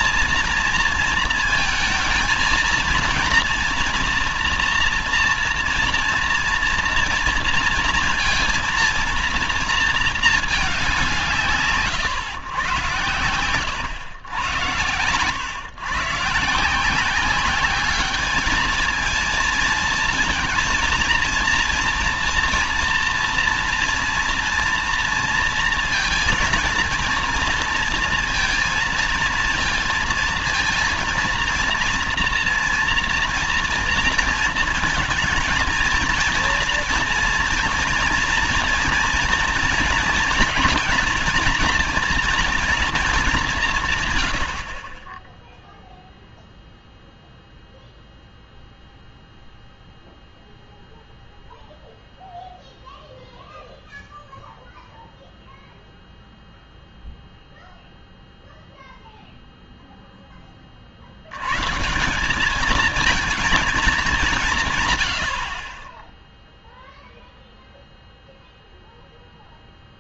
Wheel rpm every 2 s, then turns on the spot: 230, 230, 230, 230, 230, 210, 120, 110, 160, 220, 230, 240, 230, 230, 230, 230, 230, 230, 230, 230, 220, 230, 90, 0, 0, 0, 0, 0, 0, 0, 30, 200, 150, 0, 0.
none